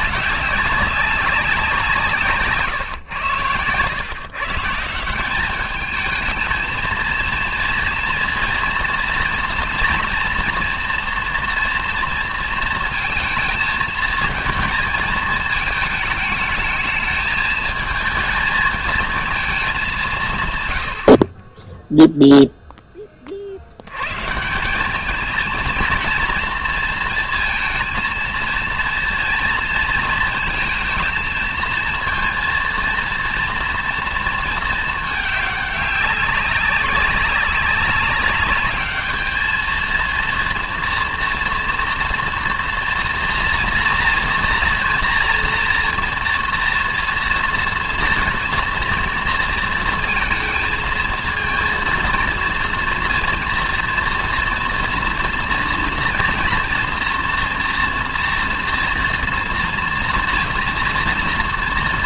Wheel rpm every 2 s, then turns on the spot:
190, 140, 160, 220, 230, 240, 230, 220, 210, 220, 100, 10, 200, 230, 230, 230, 230, 220, 200, 210, 230, 240, 230, 230, 230, 220, 230, 230, 230, 230, 230.
none